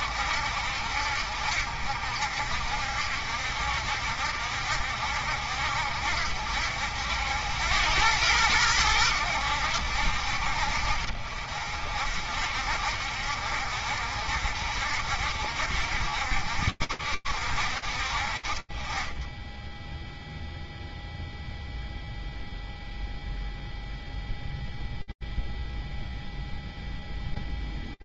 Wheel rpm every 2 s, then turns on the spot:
60, 60, 70, 90, 80, 60, 60, 60, 60, 20, 0, 0, 0, 0.
none